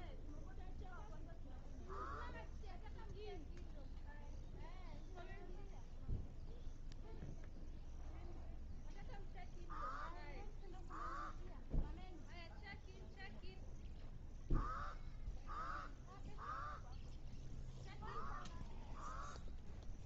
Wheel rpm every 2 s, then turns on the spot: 0, 0, 0, 0, 0, 0, 0, 0, 0, 0.
none